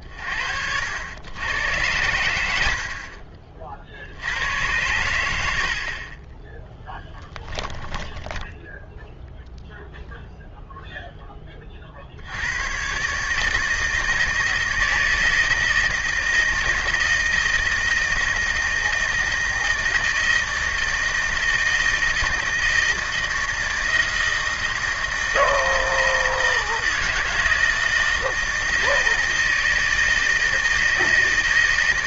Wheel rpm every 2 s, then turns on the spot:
90, 70, 100, 10, 0, 0, 120, 160, 160, 160, 160, 160, 160, 160, 160, 160.
6-8